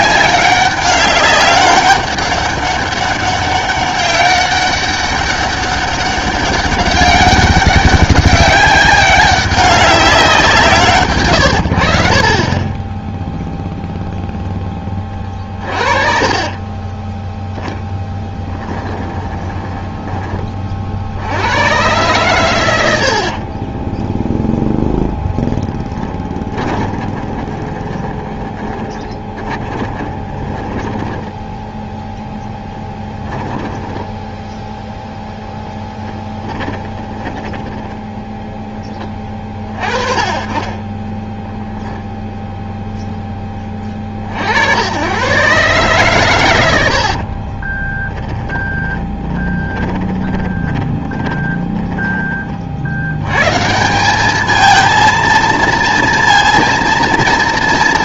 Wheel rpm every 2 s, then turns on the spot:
200, 200, 200, 200, 200, 160, 10, 10, 20, 10, 40, 100, 0, 20, 20, 10, 20, 0, 20, 10, 20, 0, 70, 90, 20, 20, 50, 220, 230.
12-14 16-20 26-34 36-38 46-52